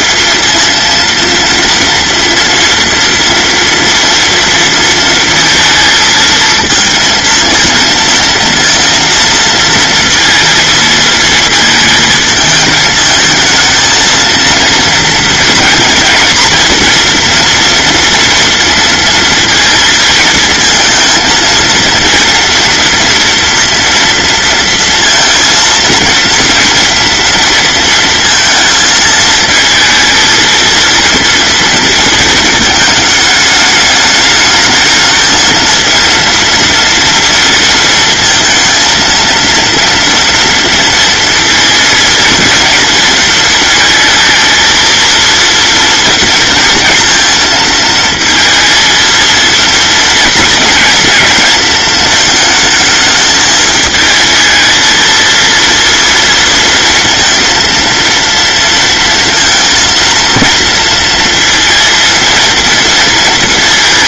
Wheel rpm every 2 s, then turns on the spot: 230, 240, 230, 230, 230, 230, 220, 230, 230, 230, 220, 240, 230, 230, 220, 230, 220, 220, 230, 230, 230, 230, 230, 230, 230, 230, 220, 220, 230, 230, 230, 230.
none